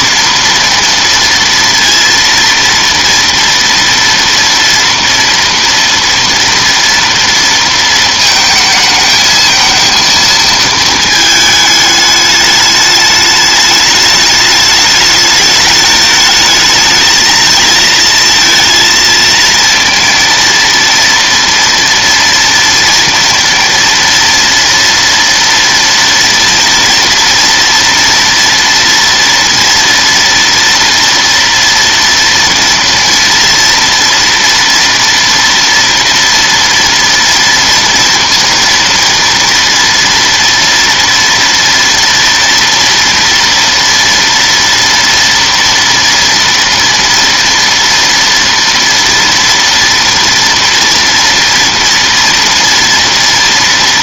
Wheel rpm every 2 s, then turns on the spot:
230, 230, 230, 230, 220, 220, 210, 210, 220, 230, 230, 230, 230, 230, 240, 230, 230, 230, 230, 230, 230, 230, 230, 230, 230, 230, 230.
none